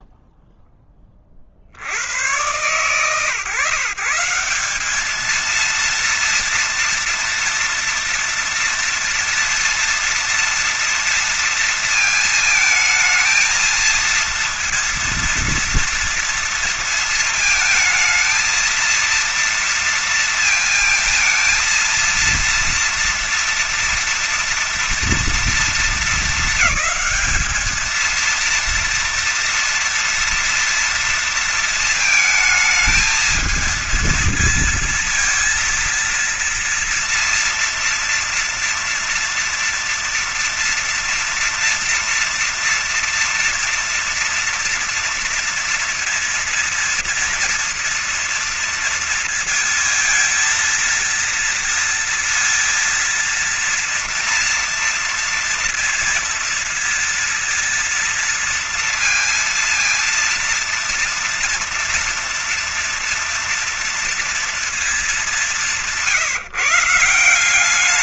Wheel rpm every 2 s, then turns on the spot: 10, 110, 180, 230, 230, 230, 220, 230, 230, 230, 230, 230, 230, 220, 230, 230, 220, 220, 230, 230, 230, 230, 230, 230, 230, 230, 230, 230, 230, 230, 230, 230, 230, 170.
none